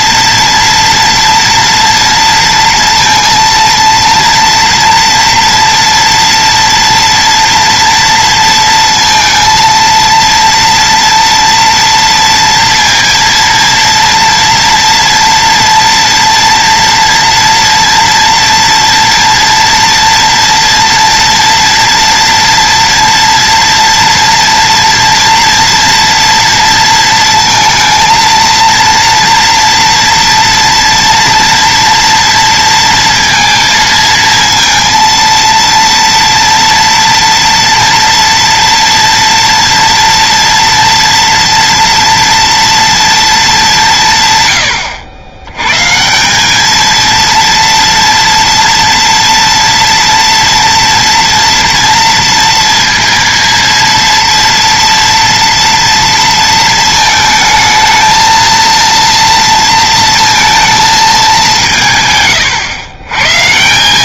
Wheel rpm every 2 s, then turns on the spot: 230, 230, 230, 230, 230, 230, 230, 230, 240, 230, 230, 240, 230, 230, 230, 230, 230, 230, 230, 230, 230, 230, 100, 210, 230, 230, 230, 230, 230, 230, 230, 120.
none